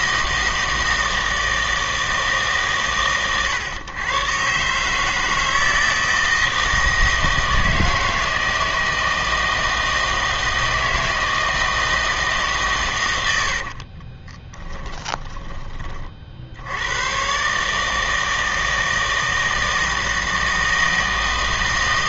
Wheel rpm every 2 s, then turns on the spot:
160, 140, 140, 160, 160, 160, 140, 20, 90, 160, 160.
14-16